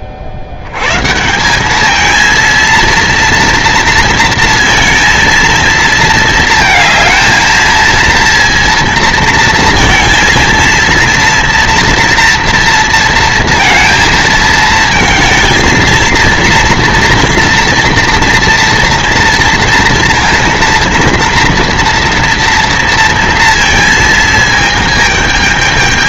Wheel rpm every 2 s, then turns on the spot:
110, 230, 230, 220, 230, 230, 230, 220, 230, 230, 230, 230, 220.
none